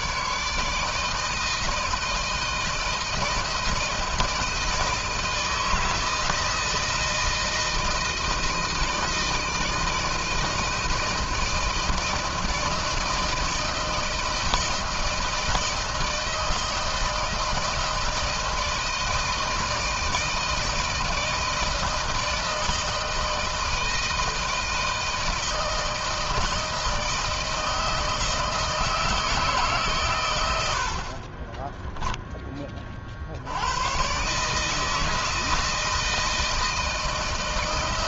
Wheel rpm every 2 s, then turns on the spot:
160, 160, 160, 160, 160, 160, 160, 160, 160, 160, 160, 160, 160, 160, 160, 100, 20, 140, 160.
30-32